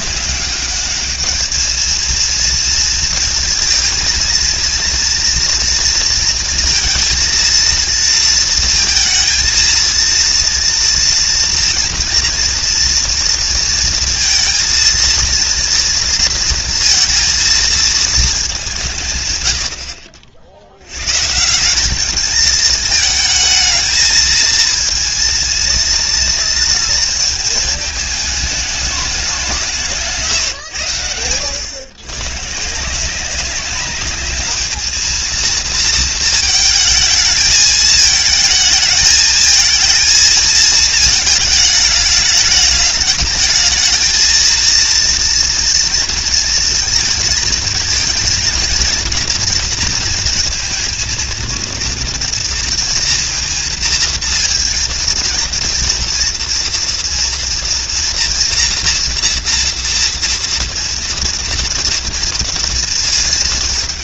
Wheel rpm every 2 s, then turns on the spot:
200, 230, 230, 230, 230, 230, 230, 230, 230, 180, 110, 220, 230, 230, 210, 100, 160, 220, 220, 220, 220, 210, 230, 230, 230, 220, 230, 230, 230, 240, 230, 230.
none